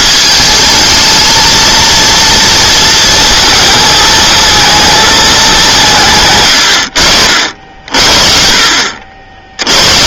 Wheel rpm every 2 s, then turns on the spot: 220, 230, 220, 100, 60.
none